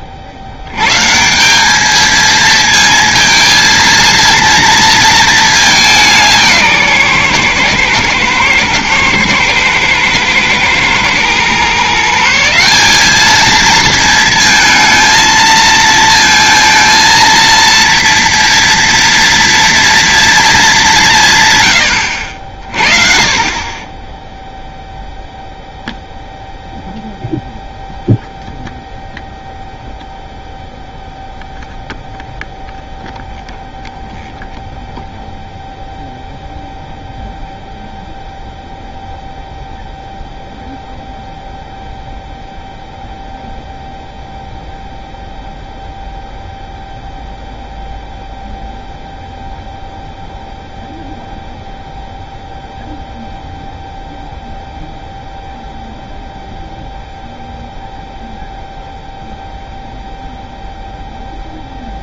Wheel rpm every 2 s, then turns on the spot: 110, 220, 230, 150, 110, 120, 190, 220, 230, 230, 200, 50, 0, 0, 0, 0, 0, 0, 0, 0, 0, 0, 0, 0, 0, 0, 0, 0, 0, 0, 0.
none